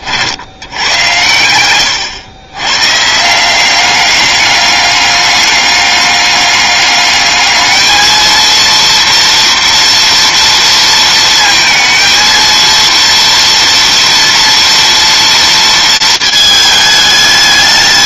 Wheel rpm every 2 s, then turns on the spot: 100, 130, 200, 200, 230, 230, 230, 230, 220.
none